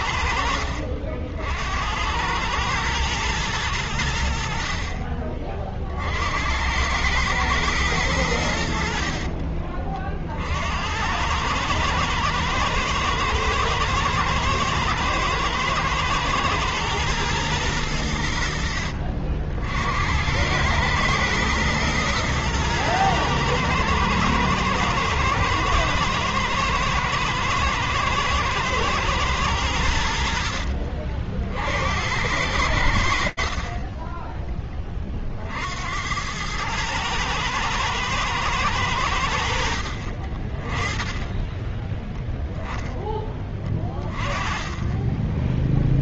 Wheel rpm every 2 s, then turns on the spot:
70, 110, 60, 90, 80, 70, 120, 120, 120, 70, 100, 120, 110, 110, 120, 60, 80, 30, 100, 100, 20, 10, 10.
44-46